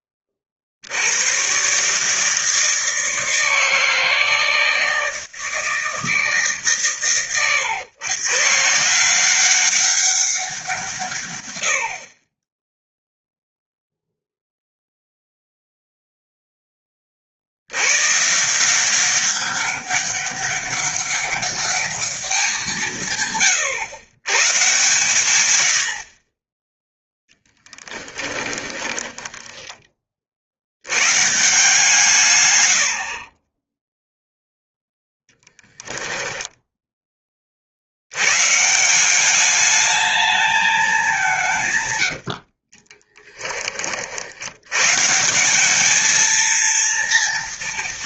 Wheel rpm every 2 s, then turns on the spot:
50, 160, 160, 140, 140, 180, 10, 0, 10, 170, 200, 180, 130, 10, 10, 100, 90, 0, 10, 150, 210, 30, 110, 230.
28-30 42-44